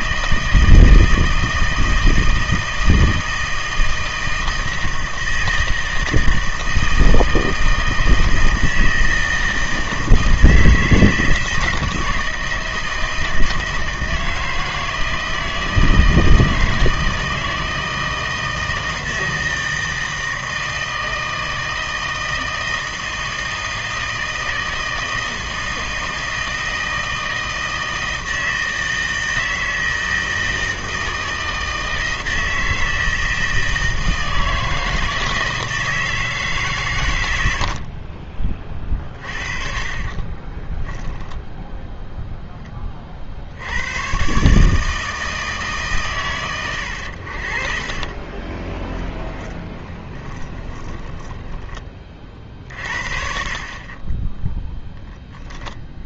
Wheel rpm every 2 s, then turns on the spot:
160, 160, 160, 160, 160, 160, 160, 160, 160, 160, 160, 160, 160, 160, 160, 160, 160, 160, 140, 40, 10, 10, 150, 100, 20, 10, 40, 0.
40-42 48-54